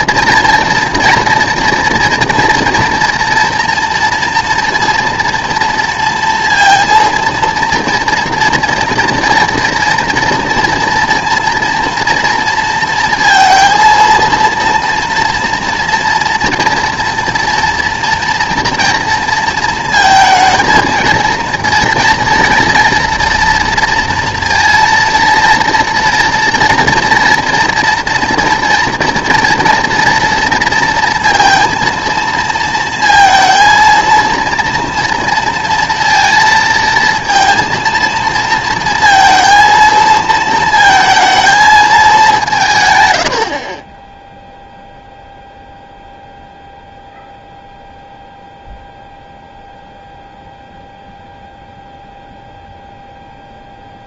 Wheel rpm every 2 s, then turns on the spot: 230, 240, 230, 230, 230, 230, 230, 230, 230, 230, 220, 230, 230, 230, 230, 230, 230, 230, 230, 230, 230, 170, 0, 0, 0, 0, 0.
none